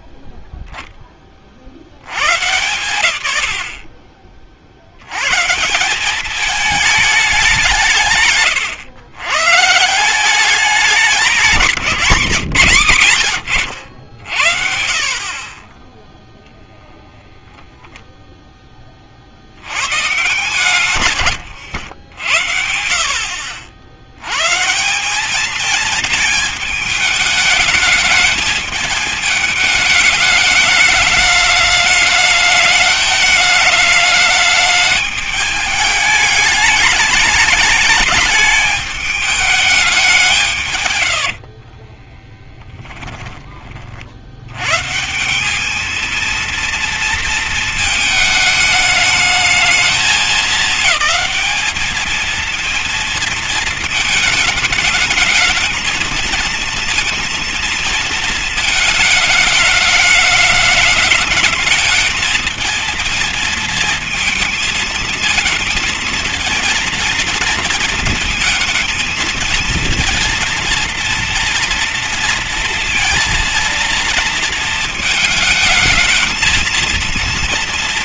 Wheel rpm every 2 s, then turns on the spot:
10, 140, 50, 200, 150, 200, 140, 60, 0, 30, 130, 60, 190, 220, 210, 210, 210, 210, 210, 210, 130, 10, 120, 230, 210, 200, 230, 210, 220, 220, 210, 220, 220, 220, 220, 230, 230, 230, 230.
20-22 40-44